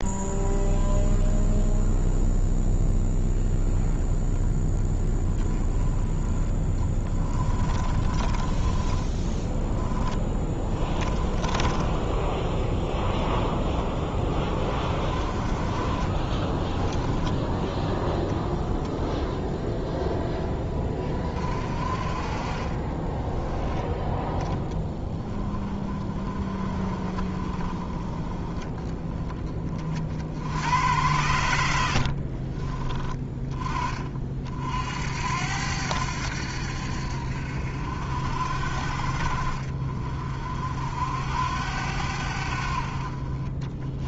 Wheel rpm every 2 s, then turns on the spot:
0, 0, 20, 30, 20, 20, 0, 30, 10, 20, 20, 20, 10, 30, 10, 90, 30, 60, 70, 50, 60, 50.
6-12 22-24